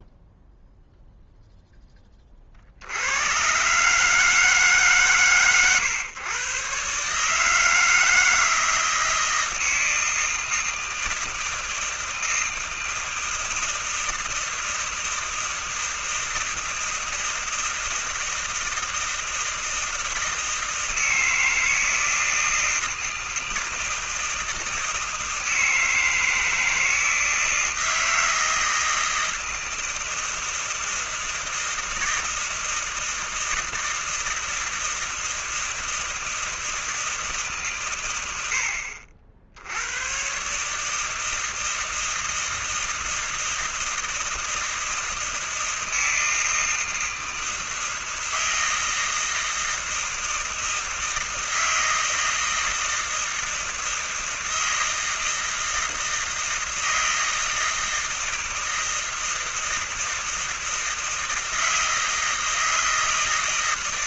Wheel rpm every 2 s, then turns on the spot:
0, 20, 150, 120, 160, 160, 160, 160, 160, 160, 160, 160, 160, 160, 160, 160, 160, 160, 160, 110, 100, 160, 160, 160, 160, 160, 160, 160, 160, 160, 160, 160.
none